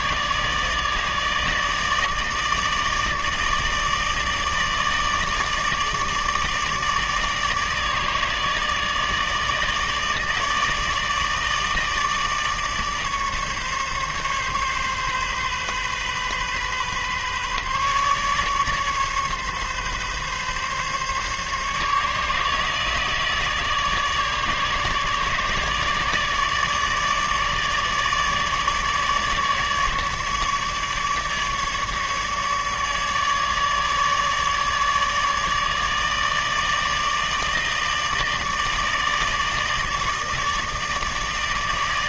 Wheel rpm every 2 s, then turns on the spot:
150, 150, 160, 160, 160, 160, 150, 140, 130, 150, 140, 150, 150, 150, 150, 150, 150, 150, 150, 160, 160.
none